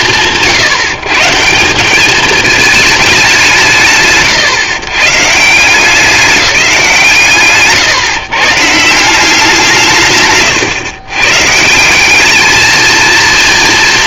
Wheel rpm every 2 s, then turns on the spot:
150, 140, 140, 160, 180, 130, 220.
none